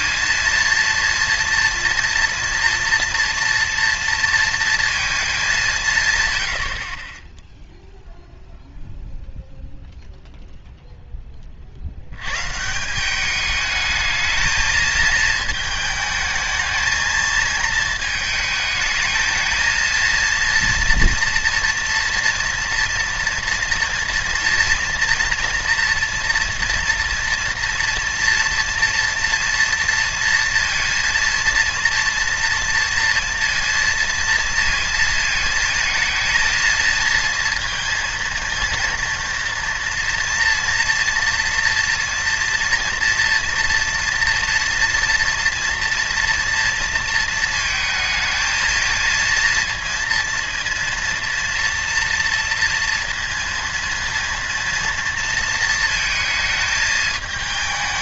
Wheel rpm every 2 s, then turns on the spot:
230, 230, 230, 60, 0, 0, 140, 220, 220, 220, 230, 230, 240, 230, 230, 230, 230, 230, 230, 230, 230, 230, 230, 230, 220, 230, 230, 230, 220.
none